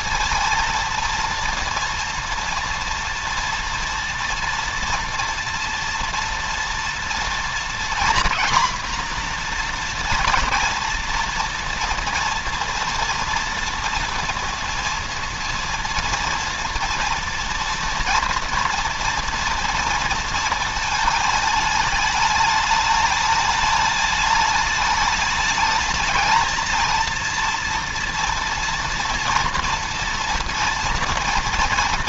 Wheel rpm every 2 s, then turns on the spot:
230, 230, 240, 230, 240, 230, 230, 230, 230, 230, 220, 210, 210, 230, 230, 240.
none